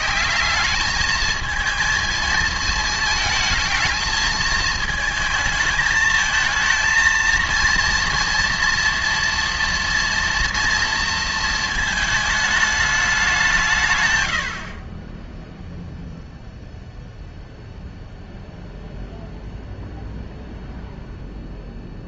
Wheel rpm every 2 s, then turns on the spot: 210, 220, 220, 230, 240, 230, 210, 40, 0, 0, 0.
none